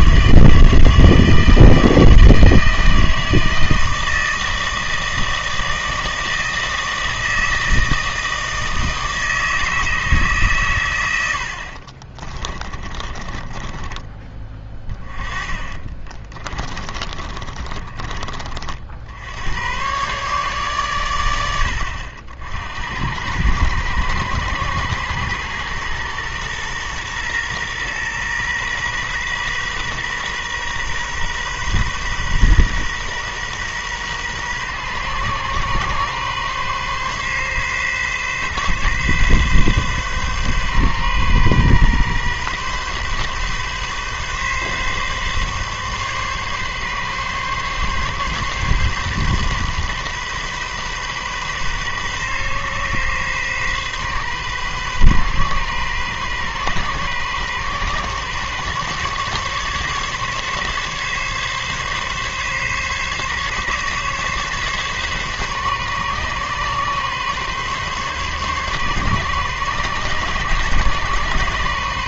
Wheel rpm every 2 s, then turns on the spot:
160, 160, 160, 160, 160, 130, 30, 20, 30, 50, 130, 70, 110, 120, 120, 130, 130, 130, 130, 130, 130, 130, 130, 140, 130, 130, 130, 130, 130, 130, 140, 140, 140, 140, 130, 130.
12-14 16-18